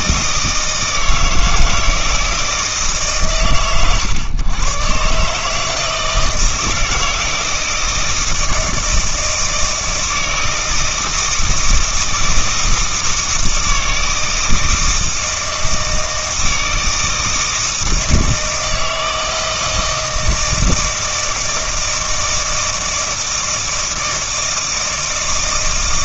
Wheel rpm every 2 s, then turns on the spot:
160, 140, 130, 160, 160, 160, 160, 160, 160, 160, 160, 160, 160.
none